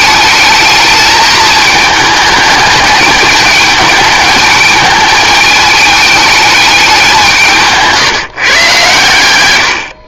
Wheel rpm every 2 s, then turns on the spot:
210, 210, 220, 200, 130.
none